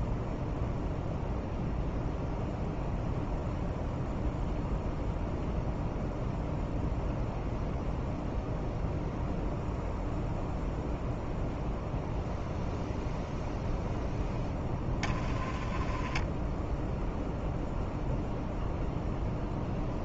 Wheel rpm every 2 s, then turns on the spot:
0, 0, 0, 0, 0, 0, 0, 10, 0, 0.
none